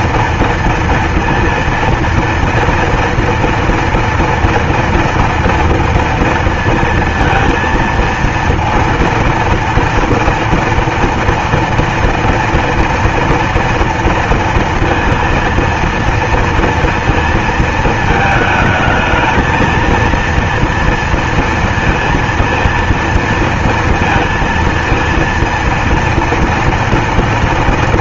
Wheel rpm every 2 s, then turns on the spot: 230, 230, 230, 230, 230, 230, 230, 230, 230, 220, 230, 230, 230, 230.
none